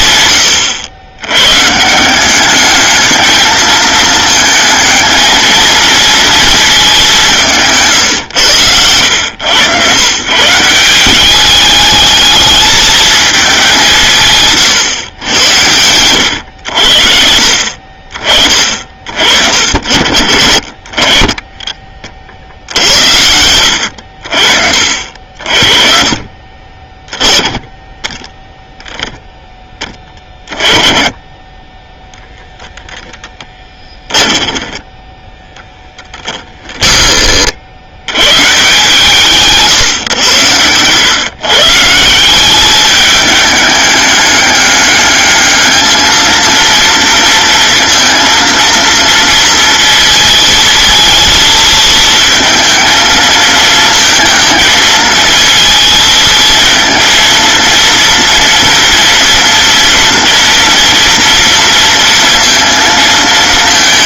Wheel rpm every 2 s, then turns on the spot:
100, 210, 220, 200, 100, 190, 210, 100, 70, 50, 30, 70, 50, 10, 10, 30, 10, 20, 30, 150, 130, 210, 210, 230, 230, 220, 220, 220, 230, 230, 230, 230.
32-36